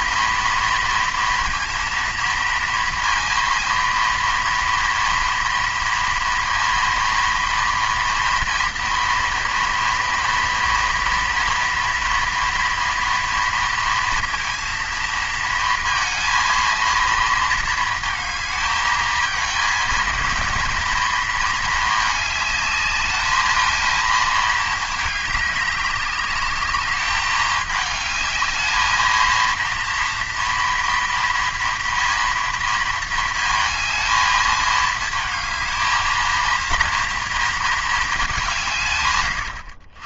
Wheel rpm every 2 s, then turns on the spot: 230, 230, 230, 230, 230, 230, 240, 230, 230, 220, 230, 210, 210, 200, 220, 230, 230, 220, 230, 160.
none